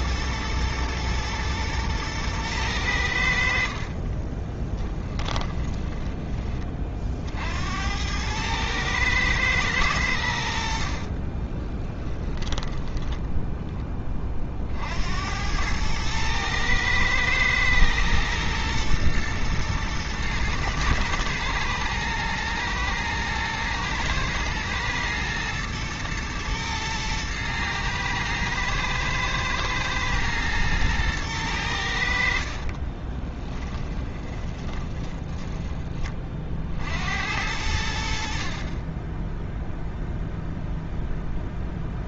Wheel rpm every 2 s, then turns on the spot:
110, 110, 30, 20, 110, 80, 10, 50, 110, 120, 110, 110, 110, 110, 110, 110, 30, 20, 30, 40, 0.
4-6 12-14 32-36